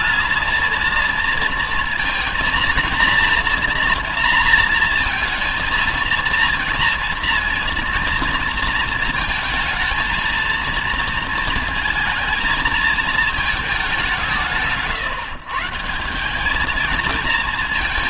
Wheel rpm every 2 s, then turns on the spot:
230, 230, 230, 230, 220, 230, 220, 170, 200.
none